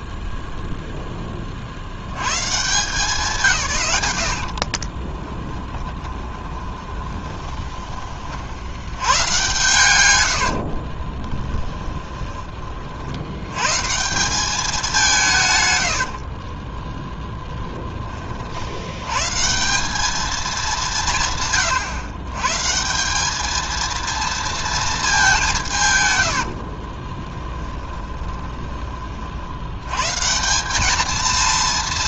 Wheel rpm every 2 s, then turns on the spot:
0, 140, 50, 20, 80, 60, 40, 190, 20, 80, 200, 160, 230, 50, 20, 200.
4-8 10-12 16-18 26-28